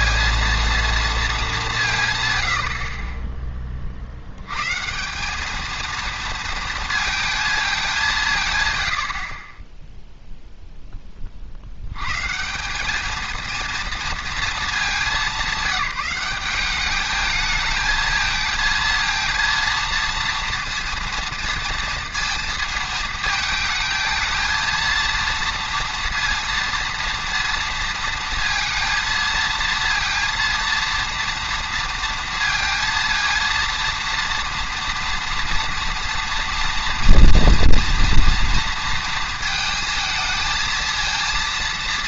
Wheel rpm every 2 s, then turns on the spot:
230, 80, 120, 230, 130, 0, 170, 220, 200, 220, 230, 230, 220, 230, 230, 230, 230, 230, 230, 230, 220.
none